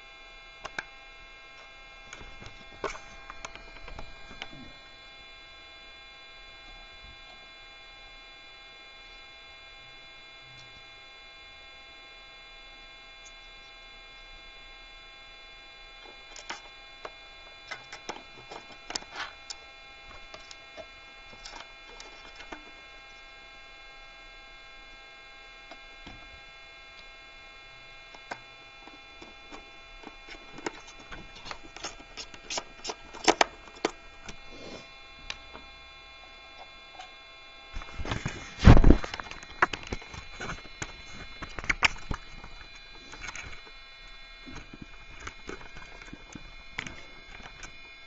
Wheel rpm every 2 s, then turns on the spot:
0, 0, 0, 0, 0, 0, 0, 0, 0, 0, 0, 0, 0, 0, 0, 0, 0, 0, 0, 0, 0, 0, 0, 0.
none